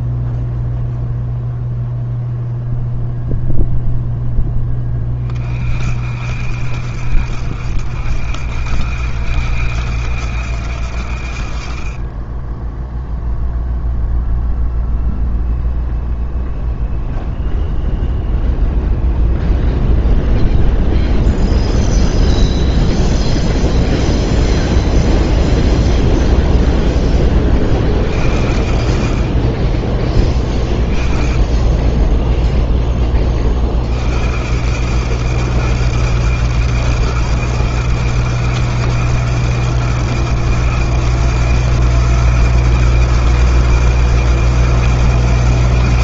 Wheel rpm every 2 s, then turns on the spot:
0, 0, 0, 50, 70, 80, 20, 0, 0, 0, 0, 0, 0, 0, 50, 20, 0, 80, 110, 120, 120, 120, 110.
12-14